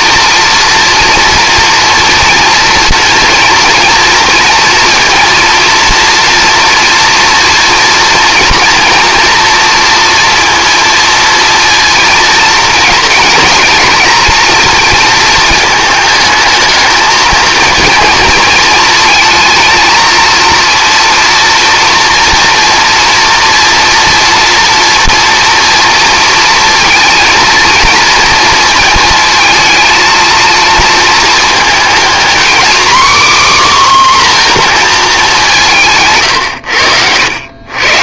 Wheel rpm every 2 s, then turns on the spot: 230, 240, 230, 230, 230, 230, 230, 220, 220, 220, 230, 230, 230, 230, 230, 230, 250, 250, 110.
none